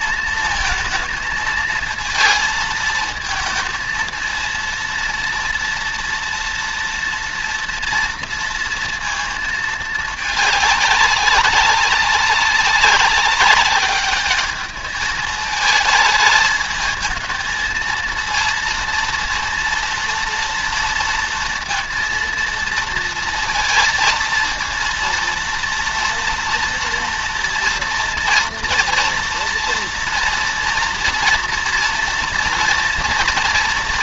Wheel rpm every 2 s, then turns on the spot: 230, 220, 230, 240, 230, 210, 200, 210, 220, 230, 230, 230, 230, 230, 230, 230, 230.
none